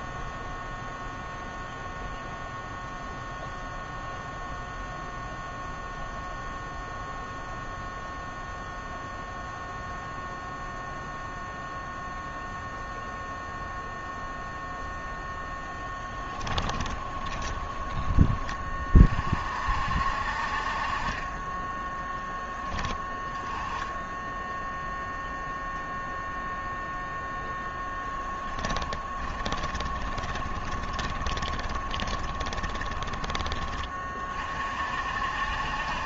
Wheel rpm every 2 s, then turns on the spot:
0, 0, 0, 0, 0, 0, 0, 0, 20, 30, 40, 10, 0, 0, 20, 10, 10, 50.
16-18 28-34